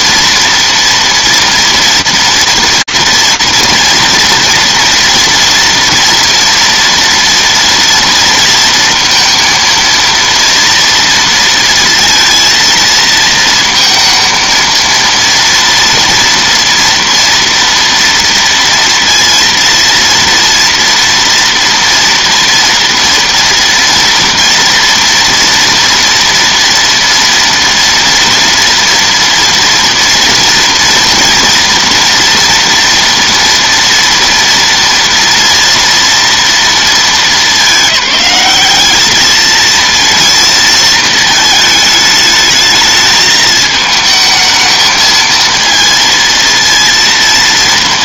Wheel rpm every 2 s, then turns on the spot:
230, 240, 240, 230, 230, 230, 230, 230, 230, 230, 230, 230, 230, 230, 230, 230, 230, 230, 220, 210, 220, 220, 220, 230.
none